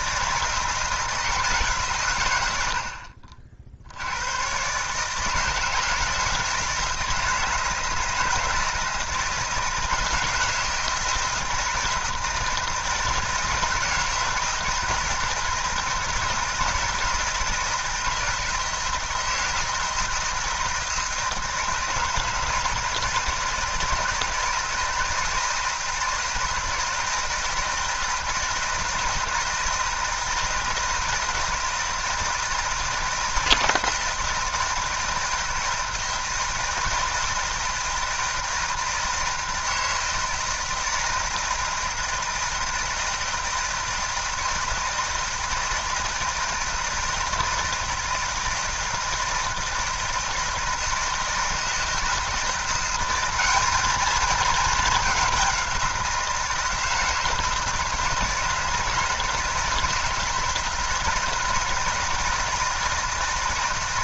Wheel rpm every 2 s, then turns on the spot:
160, 80, 130, 160, 160, 160, 160, 160, 160, 160, 160, 160, 160, 160, 160, 160, 160, 160, 160, 160, 160, 160, 160, 160, 160, 160, 180, 210, 170, 160, 160, 160.
none